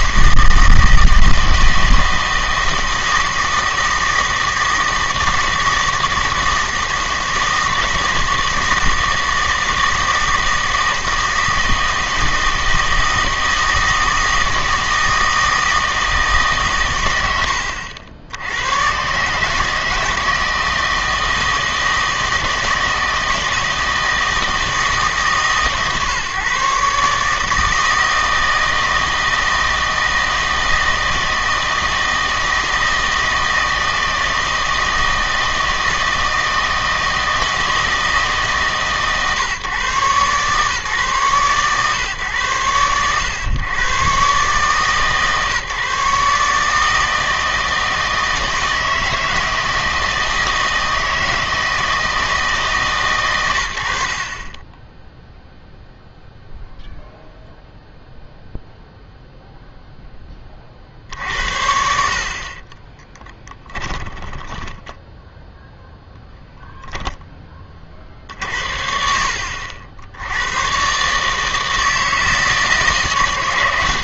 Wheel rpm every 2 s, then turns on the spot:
160, 160, 160, 160, 160, 160, 160, 160, 130, 110, 160, 160, 160, 140, 160, 160, 160, 160, 160, 150, 140, 110, 140, 150, 160, 160, 150, 20, 0, 0, 50, 30, 10, 0, 60, 120, 160.
62-66